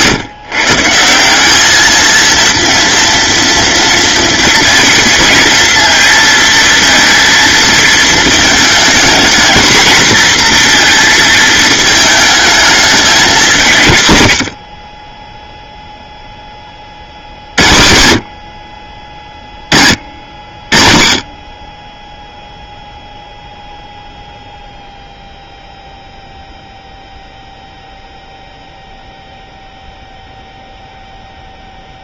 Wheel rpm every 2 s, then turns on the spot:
160, 230, 230, 230, 230, 230, 210, 40, 50, 30, 50, 0, 0, 0, 0, 0.
14-16